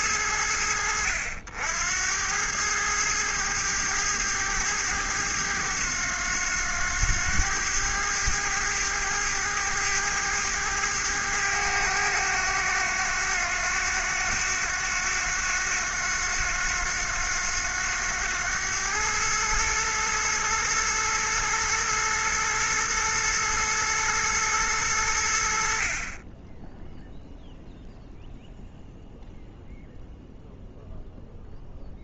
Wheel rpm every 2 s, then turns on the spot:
80, 100, 110, 100, 100, 100, 100, 100, 90, 100, 110, 120, 110, 10, 0, 0.
none